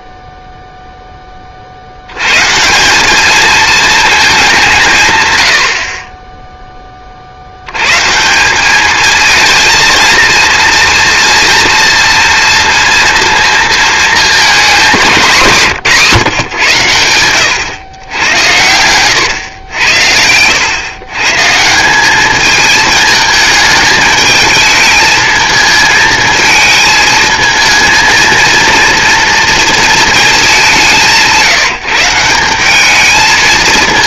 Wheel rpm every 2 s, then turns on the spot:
0, 170, 160, 30, 210, 230, 230, 210, 100, 120, 120, 220, 220, 220, 230, 160, 210.
none